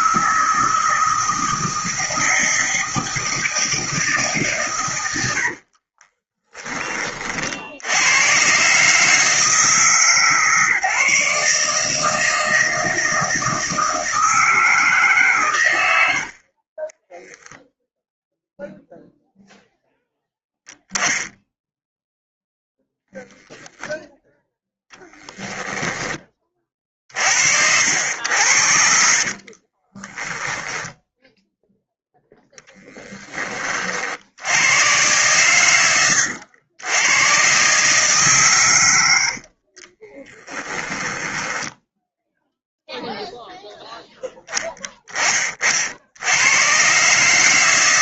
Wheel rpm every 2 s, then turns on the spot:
160, 160, 140, 20, 130, 150, 160, 160, 40, 0, 0, 10, 0, 30, 70, 10, 10, 90, 90, 130, 10, 0, 10, 100.
16-18 40-42